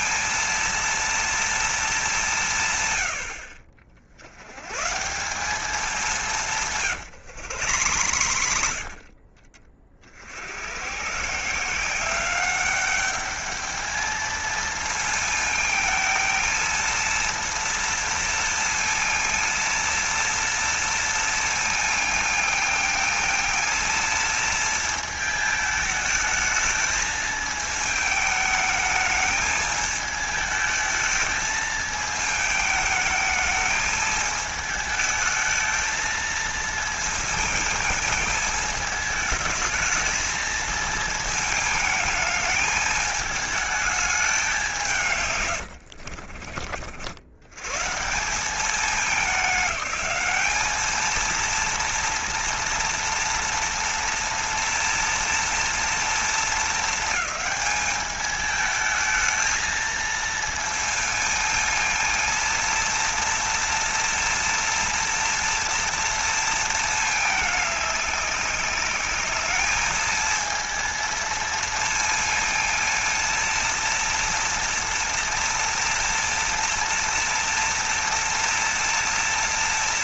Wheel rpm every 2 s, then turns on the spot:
230, 140, 130, 150, 70, 100, 200, 220, 230, 230, 230, 220, 230, 220, 220, 220, 220, 220, 230, 220, 220, 220, 190, 50, 200, 210, 230, 240, 230, 220, 230, 230, 230, 230, 200, 230, 230, 230, 230, 230.
6-10